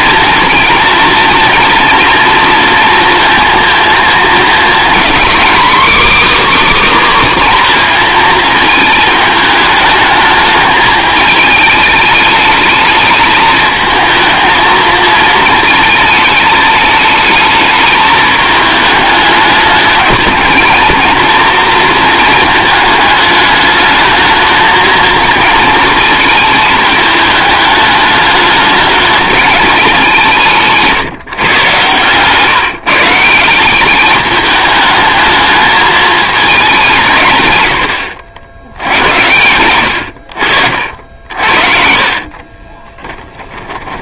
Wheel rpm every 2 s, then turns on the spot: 230, 220, 240, 290, 220, 220, 220, 220, 220, 210, 230, 220, 220, 220, 210, 170, 160, 210, 180, 80, 60, 20.
40-44